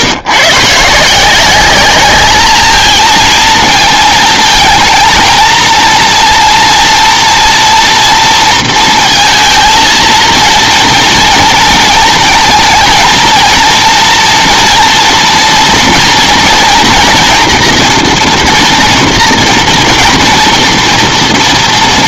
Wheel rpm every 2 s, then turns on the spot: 150, 220, 220, 230, 230, 230, 220, 240, 230, 240, 240.
none